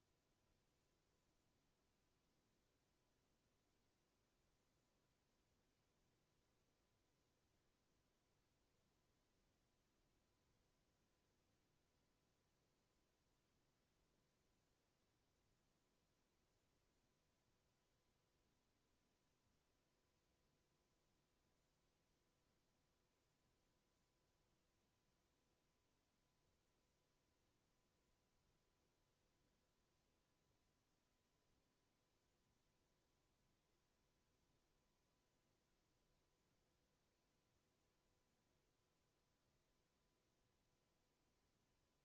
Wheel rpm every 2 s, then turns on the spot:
0, 0, 0, 0, 0, 0, 0, 0, 0, 0, 0, 0, 0, 0, 0, 0, 0, 0, 0, 0, 0.
none